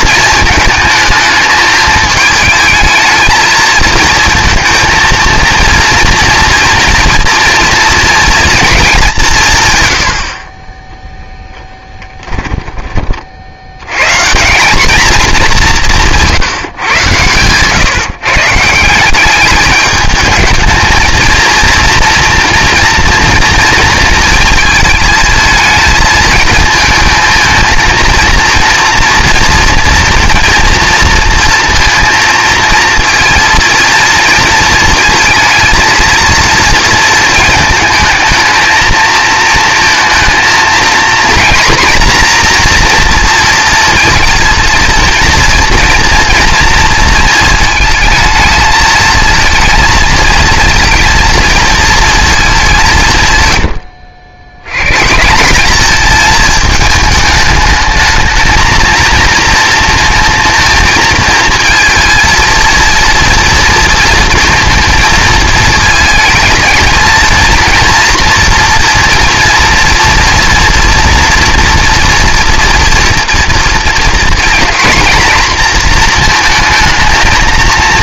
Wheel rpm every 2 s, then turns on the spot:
220, 220, 230, 230, 220, 30, 20, 190, 140, 170, 220, 230, 230, 220, 230, 230, 220, 230, 230, 220, 230, 240, 230, 230, 220, 230, 200, 90, 220, 220, 230, 230, 230, 230, 230, 230, 230, 240, 230.
12-14